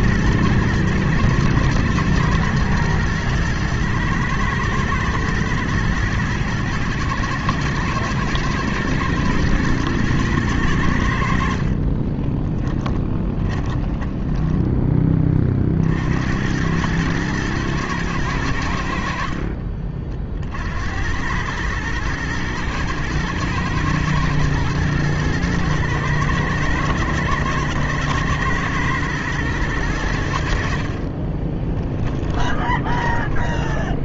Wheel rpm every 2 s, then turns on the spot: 110, 120, 120, 110, 120, 100, 10, 10, 90, 100, 60, 110, 120, 110, 110, 80, 20.
12-16 32-34